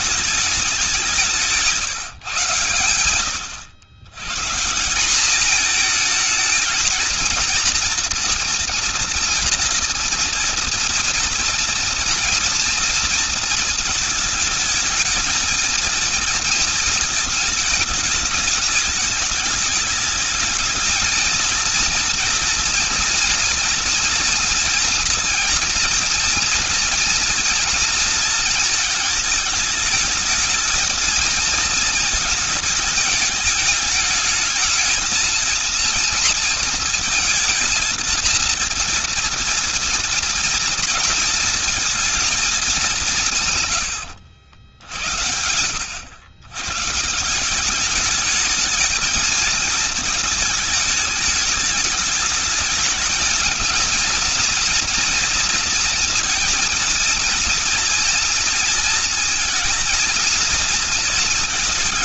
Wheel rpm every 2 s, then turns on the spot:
200, 120, 150, 220, 230, 230, 230, 220, 230, 210, 220, 230, 240, 230, 230, 220, 220, 220, 230, 230, 230, 210, 80, 120, 220, 220, 220, 230, 230, 230, 230.
none